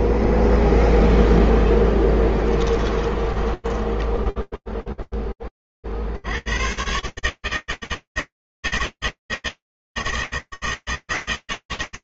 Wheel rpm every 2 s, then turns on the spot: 0, 10, 0, 90, 160, 160.
2-4